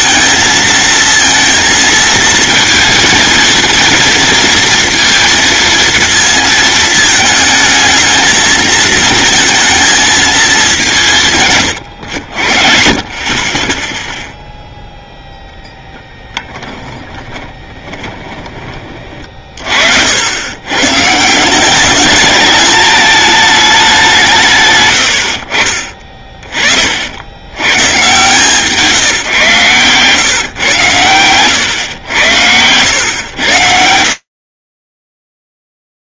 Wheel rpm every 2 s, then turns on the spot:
230, 230, 230, 220, 220, 190, 50, 0, 10, 30, 120, 210, 110, 40, 160, 130, 110, 30.
16-18